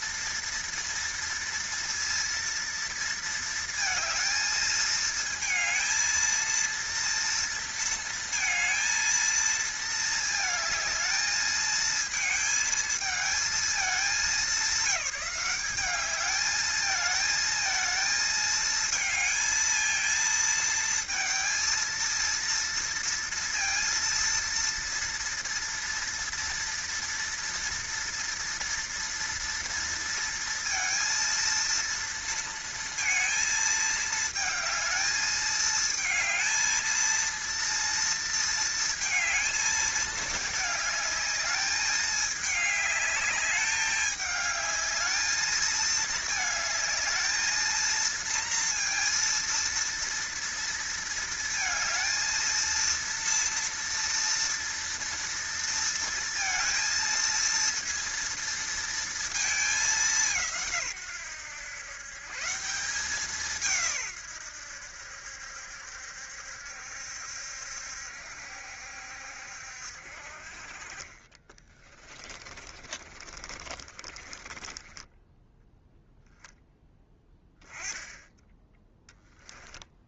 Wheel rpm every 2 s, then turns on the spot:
230, 230, 220, 230, 230, 220, 220, 210, 220, 220, 220, 230, 230, 230, 230, 230, 230, 220, 230, 230, 210, 210, 220, 220, 230, 230, 230, 230, 230, 230, 130, 180, 80, 70, 70, 30, 30, 20, 10, 10.
70-76